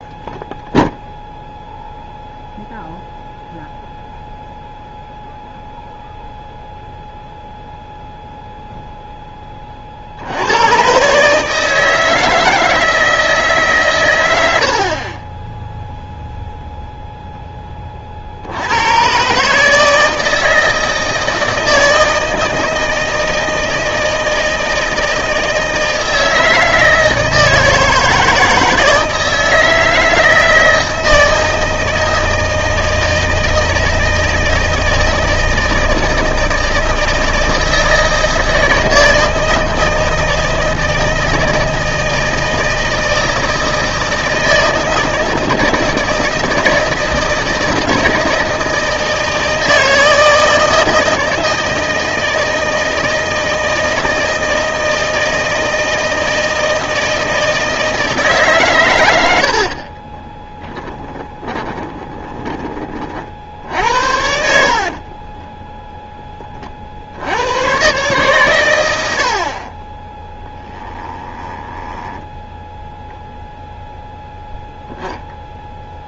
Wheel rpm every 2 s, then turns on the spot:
0, 0, 0, 0, 0, 110, 160, 70, 0, 100, 160, 160, 160, 160, 160, 160, 160, 160, 160, 160, 160, 160, 160, 160, 160, 160, 160, 160, 160, 120, 10, 20, 50, 40, 90, 10, 0, 0.
60-62 64-66 70-72